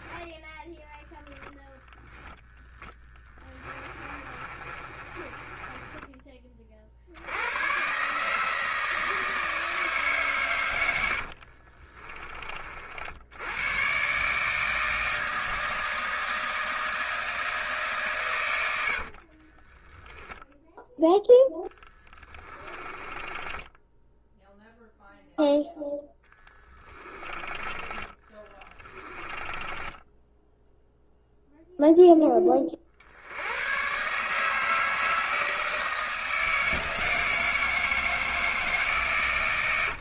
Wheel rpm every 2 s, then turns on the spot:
10, 10, 30, 60, 160, 80, 70, 160, 160, 70, 0, 20, 0, 20, 10, 0, 50, 160, 160, 160.
2-6 10-12 18-20 22-24 26-30